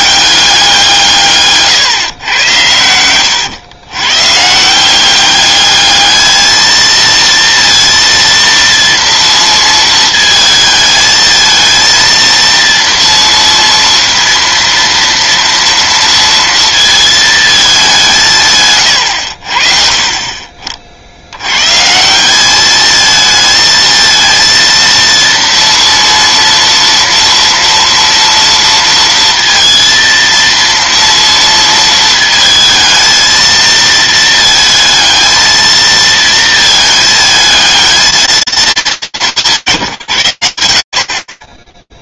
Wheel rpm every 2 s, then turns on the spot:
190, 110, 150, 220, 230, 220, 230, 230, 230, 140, 40, 210, 230, 230, 230, 230, 220, 230, 220, 210, 80.
none